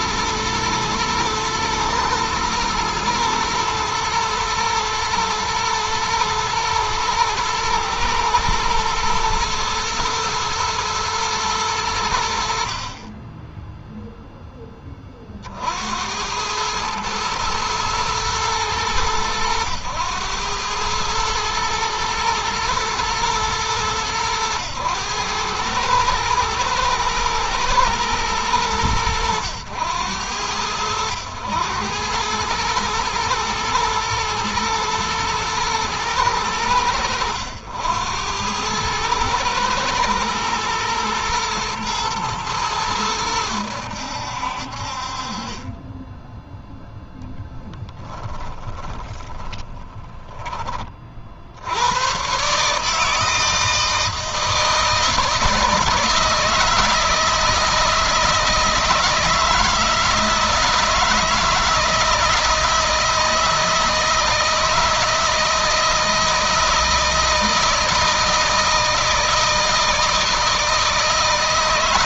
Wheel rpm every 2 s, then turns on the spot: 110, 110, 120, 110, 110, 110, 20, 30, 110, 110, 110, 120, 110, 110, 100, 90, 110, 110, 90, 110, 120, 100, 50, 0, 10, 30, 150, 160, 160, 160, 160, 160, 160, 160, 170, 160.
48-50